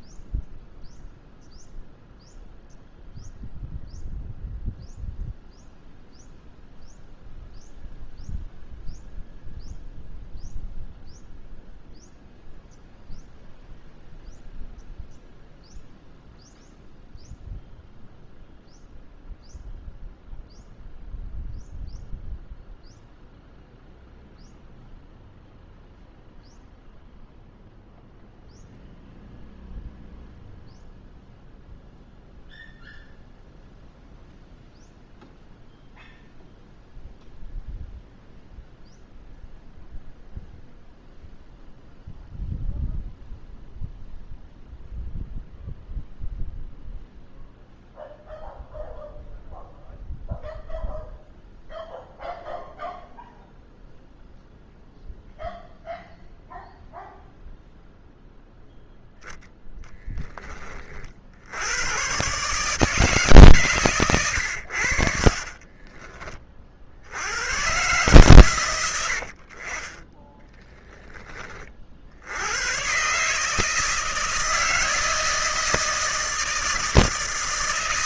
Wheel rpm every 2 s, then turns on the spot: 0, 0, 0, 0, 0, 0, 0, 0, 0, 0, 0, 0, 0, 0, 0, 0, 0, 0, 0, 0, 0, 0, 0, 0, 0, 0, 0, 0, 0, 0, 20, 140, 90, 40, 110, 30, 100, 160, 160.
70-72